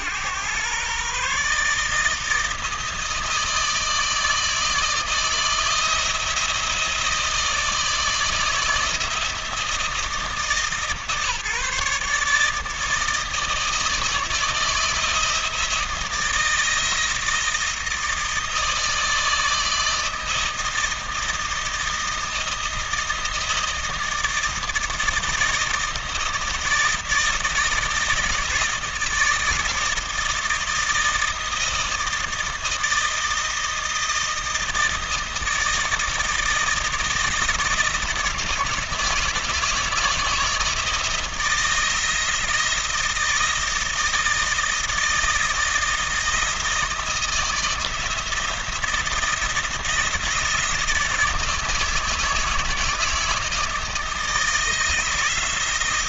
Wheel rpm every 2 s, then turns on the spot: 120, 160, 160, 170, 160, 160, 150, 160, 160, 160, 160, 160, 160, 160, 160, 170, 160, 160, 160, 160, 160, 160, 160, 160, 160, 170, 160, 160.
none